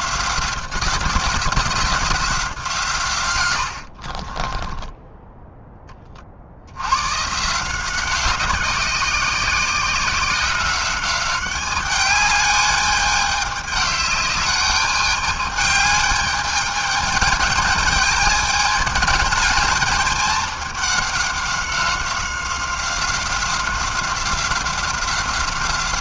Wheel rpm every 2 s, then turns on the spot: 180, 170, 20, 70, 180, 190, 210, 210, 210, 210, 210, 190, 190.
4-6